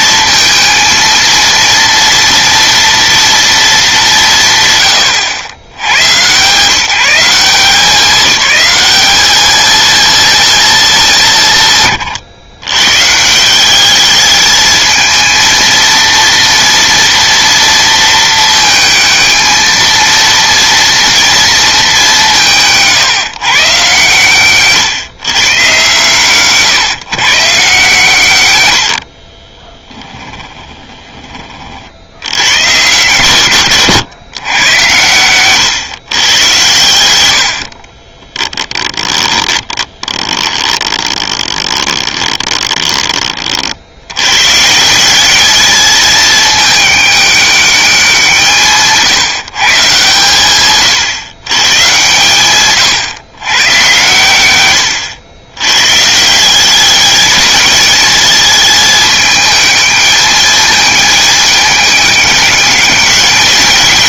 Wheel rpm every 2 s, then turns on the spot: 220, 230, 130, 170, 200, 210, 140, 220, 230, 220, 230, 150, 130, 130, 80, 10, 110, 100, 110, 10, 20, 20, 180, 210, 150, 130, 130, 100, 200, 210, 220, 200.
28-30 36-42